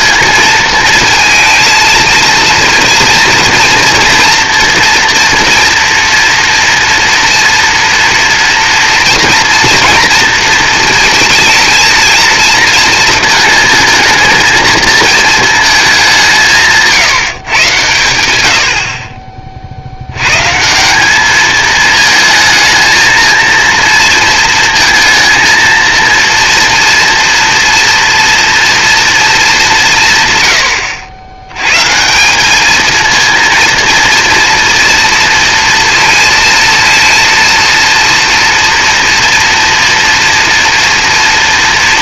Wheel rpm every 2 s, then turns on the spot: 230, 230, 240, 240, 230, 230, 230, 230, 160, 50, 200, 220, 230, 230, 230, 90, 230, 230, 230, 230, 230.
none